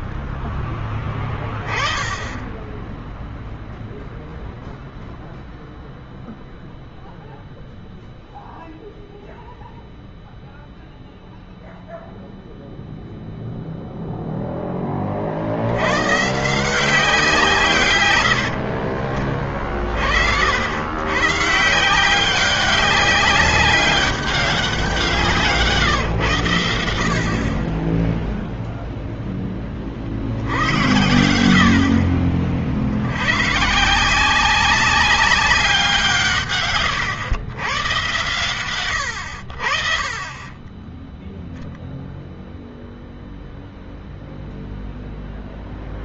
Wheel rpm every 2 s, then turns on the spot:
30, 10, 0, 0, 0, 0, 0, 30, 170, 60, 110, 200, 180, 80, 0, 100, 80, 190, 120, 110, 10, 0, 0.
0-2